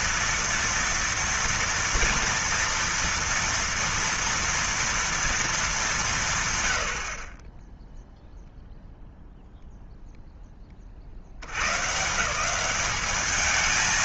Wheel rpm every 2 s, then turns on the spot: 230, 230, 230, 100, 0, 30, 190.
none